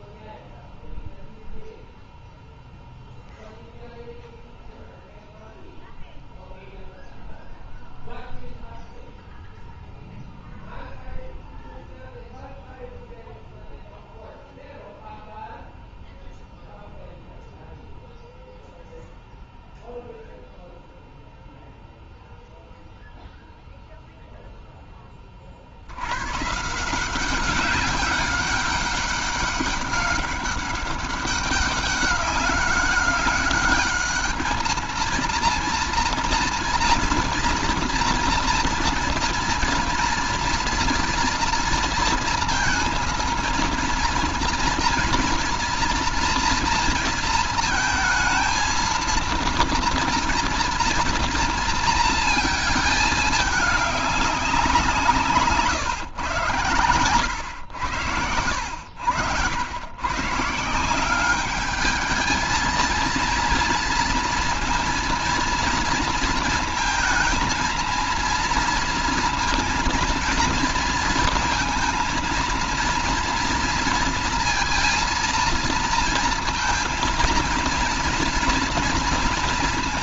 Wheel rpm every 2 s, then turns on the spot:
0, 0, 0, 0, 0, 0, 0, 0, 0, 0, 0, 0, 20, 180, 200, 200, 200, 230, 230, 230, 230, 230, 230, 230, 230, 230, 210, 170, 100, 90, 190, 230, 230, 220, 230, 230, 230, 230, 230, 230.
56-58